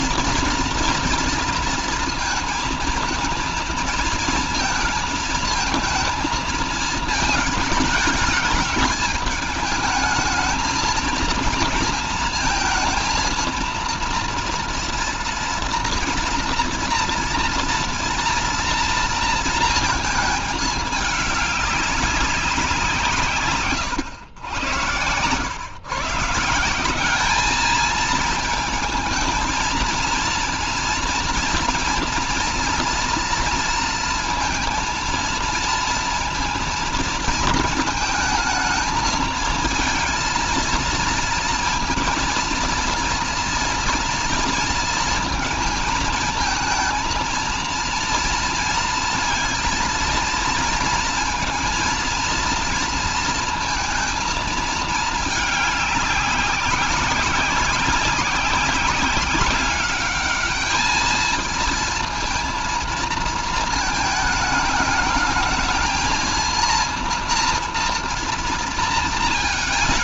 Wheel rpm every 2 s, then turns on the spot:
230, 230, 220, 220, 210, 220, 230, 230, 230, 230, 210, 170, 110, 180, 220, 230, 230, 230, 230, 220, 230, 230, 230, 220, 230, 230, 230, 220, 190, 190, 220, 230, 220, 230, 230.
none